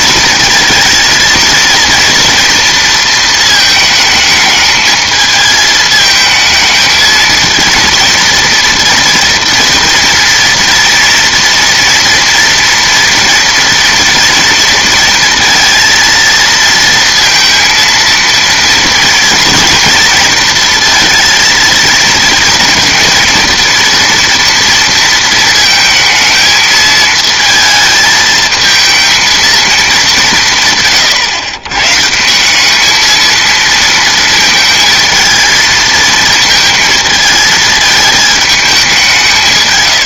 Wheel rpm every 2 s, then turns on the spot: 230, 230, 220, 220, 230, 230, 230, 230, 230, 230, 220, 230, 230, 220, 220, 150, 200, 220, 230, 210.
none